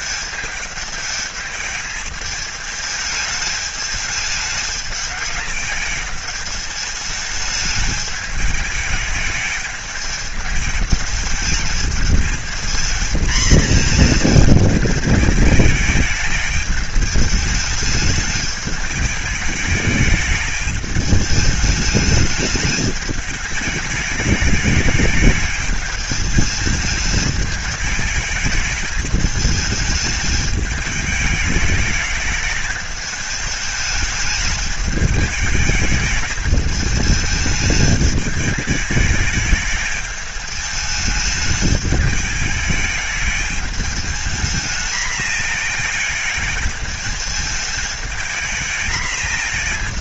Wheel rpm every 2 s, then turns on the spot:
210, 210, 220, 210, 210, 210, 220, 220, 220, 210, 210, 220, 210, 220, 220, 210, 210, 210, 210, 210, 210, 220, 230, 220, 230.
none